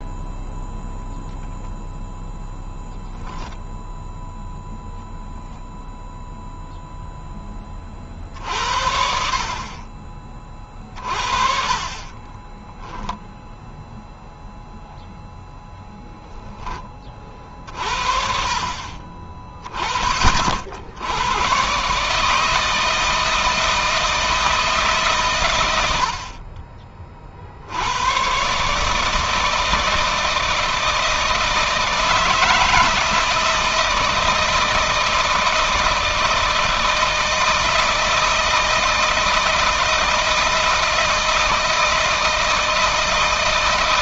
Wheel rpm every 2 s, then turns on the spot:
0, 0, 0, 0, 60, 40, 0, 0, 30, 40, 80, 160, 140, 40, 150, 160, 160, 160, 160, 160, 160, 160.
none